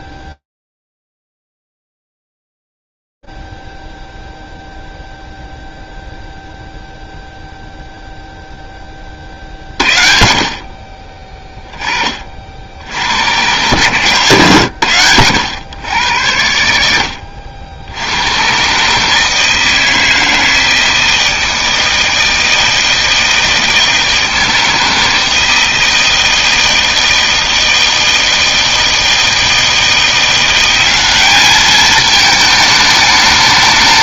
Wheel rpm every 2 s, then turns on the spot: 10, 0, 0, 0, 0, 60, 60, 120, 80, 120, 160, 160, 160, 160, 160, 180, 210.
none